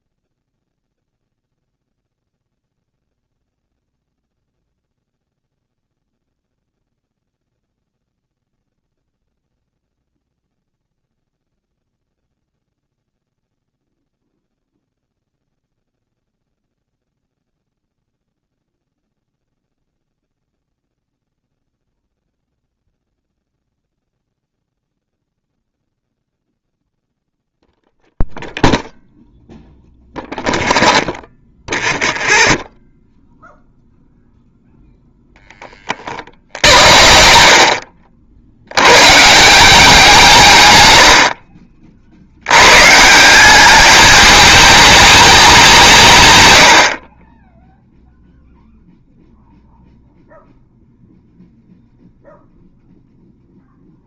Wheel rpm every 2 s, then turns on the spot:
0, 0, 0, 0, 0, 0, 0, 0, 0, 0, 0, 0, 0, 0, 0, 0, 0, 0, 70, 90, 130, 110, 210, 90, 0, 0, 0.
none